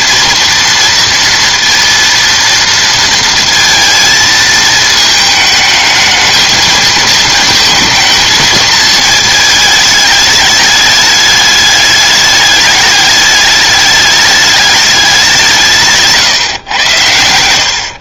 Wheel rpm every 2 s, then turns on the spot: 230, 230, 220, 220, 220, 210, 210, 210, 130.
none